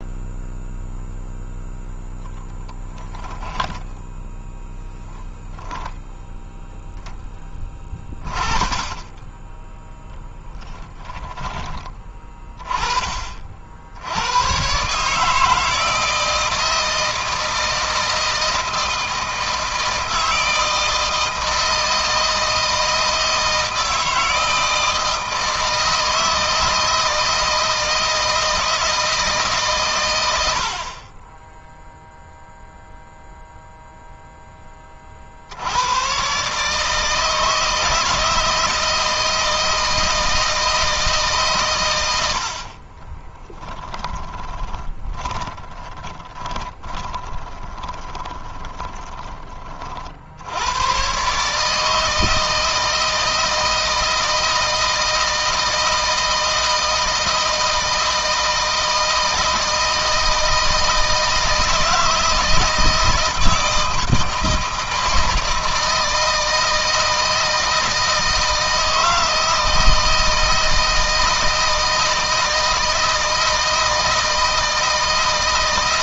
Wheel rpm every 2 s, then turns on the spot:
0, 10, 10, 10, 30, 10, 40, 140, 160, 160, 160, 160, 160, 160, 160, 40, 0, 30, 150, 160, 160, 40, 20, 20, 20, 120, 160, 160, 160, 160, 160, 160, 160, 160, 160, 160, 170, 160.
2-4 42-50